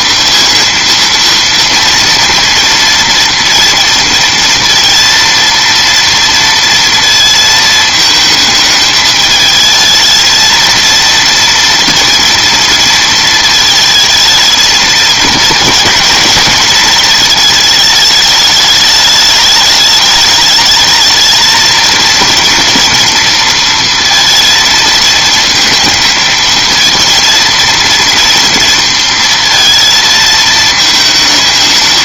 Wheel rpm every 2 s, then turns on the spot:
230, 230, 230, 230, 220, 230, 230, 230, 220, 210, 220, 230, 220, 220, 230, 220.
none